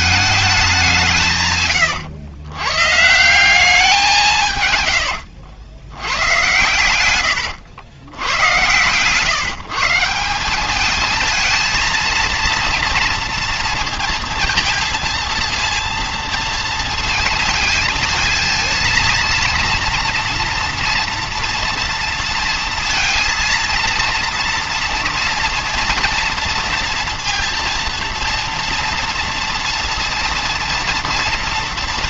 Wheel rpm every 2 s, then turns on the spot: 200, 120, 130, 120, 110, 190, 230, 230, 230, 230, 230, 230, 230, 230, 230, 230.
none